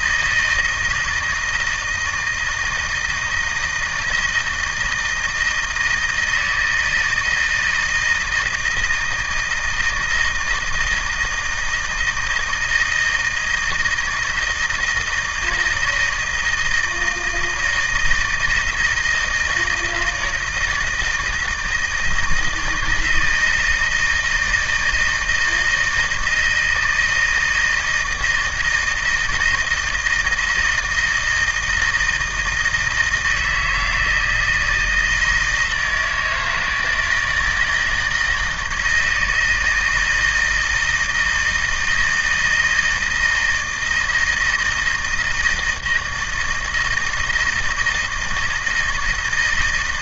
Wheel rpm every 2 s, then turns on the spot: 160, 160, 160, 160, 160, 160, 170, 160, 160, 160, 160, 160, 160, 160, 160, 160, 160, 160, 160, 160, 160, 160, 170, 160, 160.
none